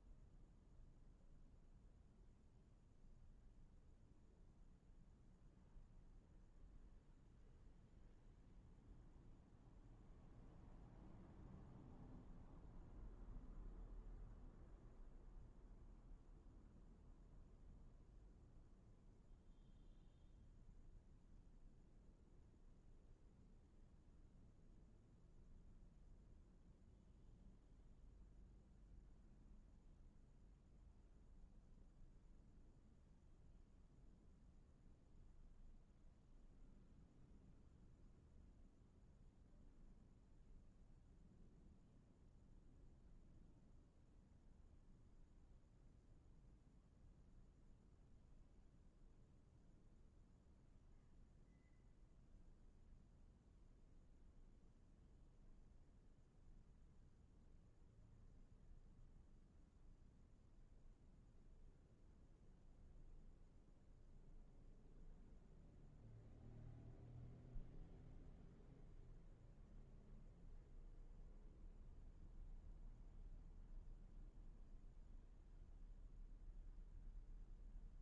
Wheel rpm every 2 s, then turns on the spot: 0, 0, 0, 0, 0, 0, 0, 0, 0, 0, 0, 0, 0, 0, 0, 0, 0, 0, 0, 0, 0, 0, 0, 0, 0, 0, 0, 0, 0, 0, 0, 0, 0, 0, 0, 0, 0, 0, 0.
none